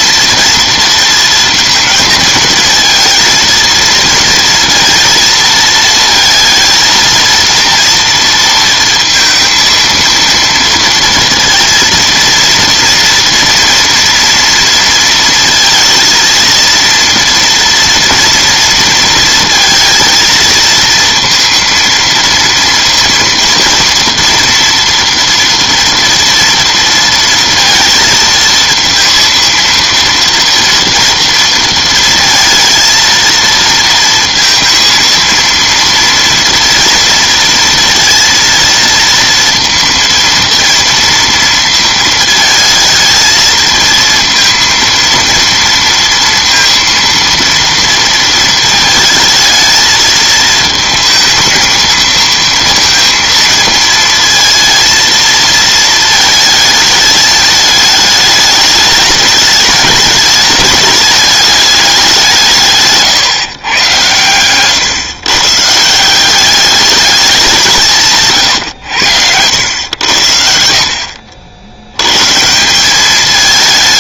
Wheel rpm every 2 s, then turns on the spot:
230, 230, 230, 220, 230, 230, 230, 230, 230, 230, 230, 230, 230, 230, 230, 230, 230, 230, 230, 230, 230, 220, 230, 230, 220, 220, 230, 230, 220, 210, 210, 150, 130, 200, 110, 60, 170.
none